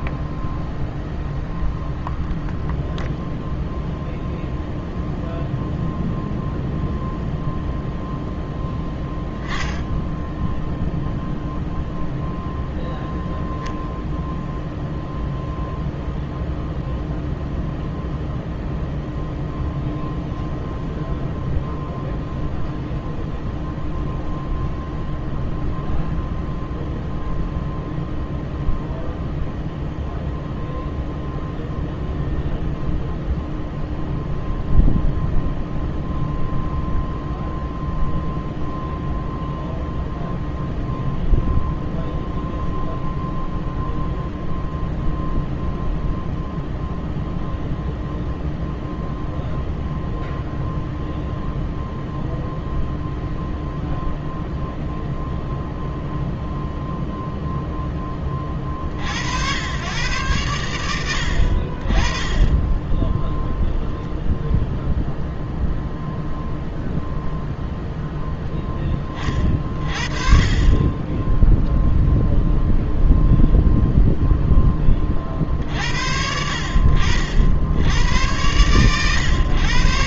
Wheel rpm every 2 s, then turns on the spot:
0, 0, 0, 0, 0, 0, 0, 0, 0, 0, 0, 0, 0, 0, 0, 0, 0, 0, 0, 0, 0, 0, 0, 0, 0, 0, 0, 0, 0, 60, 80, 10, 0, 0, 20, 20, 0, 30, 60, 110.
none